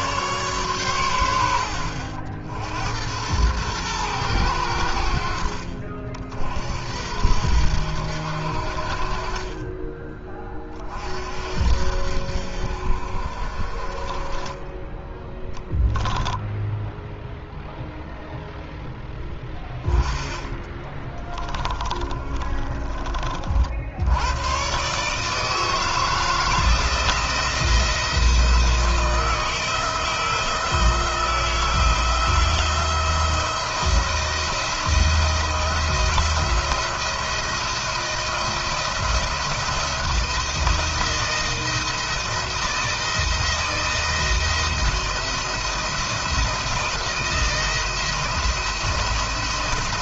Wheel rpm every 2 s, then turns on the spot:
130, 80, 90, 60, 60, 30, 60, 10, 0, 10, 20, 20, 130, 160, 170, 160, 170, 170, 170, 170, 170, 170, 170, 170, 170.
20-24